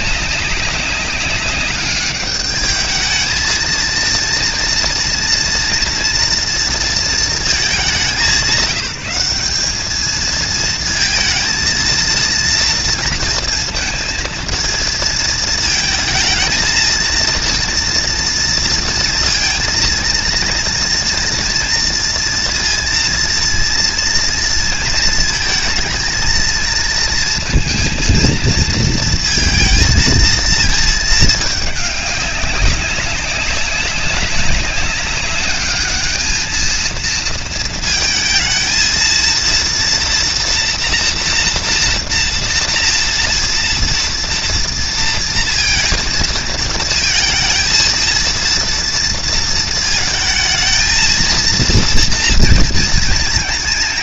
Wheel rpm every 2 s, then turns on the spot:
200, 210, 230, 230, 200, 220, 230, 230, 230, 230, 230, 230, 230, 230, 220, 220, 200, 200, 220, 230, 240, 230, 230, 220, 230, 230, 230.
none